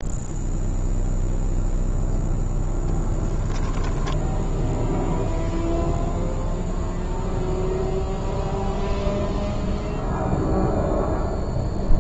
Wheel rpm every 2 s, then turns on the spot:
0, 10, 0, 0, 0, 0.
2-4